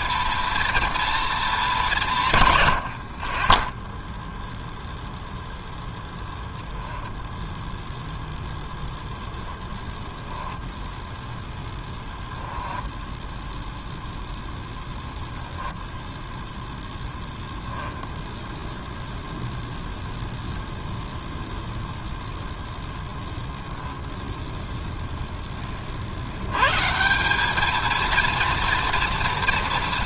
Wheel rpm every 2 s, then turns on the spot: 230, 50, 0, 0, 0, 0, 10, 0, 0, 0, 0, 0, 0, 140, 230.
12-14